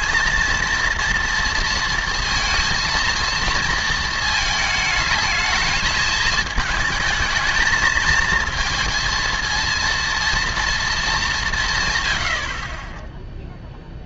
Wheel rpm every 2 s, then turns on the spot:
230, 230, 220, 210, 220, 230, 40.
none